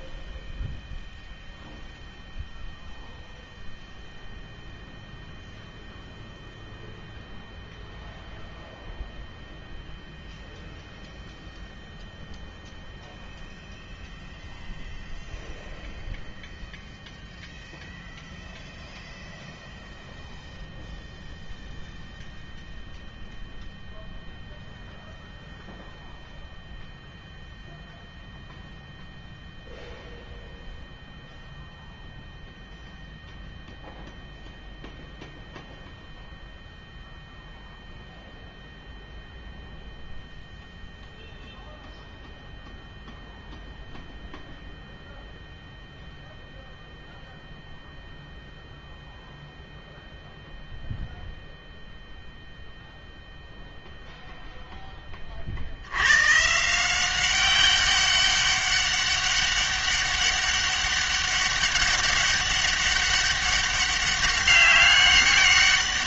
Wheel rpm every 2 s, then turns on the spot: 0, 0, 0, 0, 0, 0, 0, 0, 0, 0, 0, 0, 0, 0, 0, 0, 0, 0, 0, 0, 0, 0, 0, 0, 0, 0, 0, 0, 150, 200, 200, 200, 200.
none